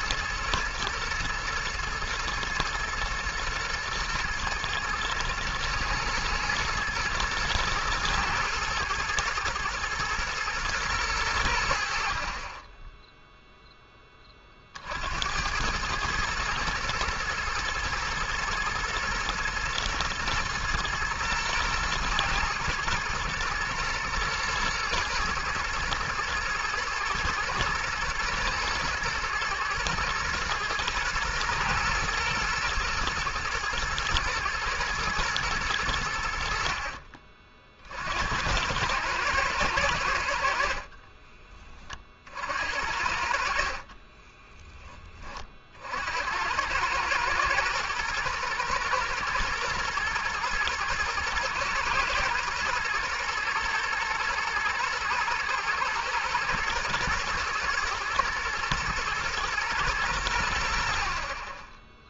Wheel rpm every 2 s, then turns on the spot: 120, 120, 110, 120, 110, 110, 10, 50, 110, 120, 120, 110, 120, 120, 120, 120, 120, 110, 50, 100, 60, 60, 10, 100, 110, 110, 110, 110, 110, 110, 70.
40-42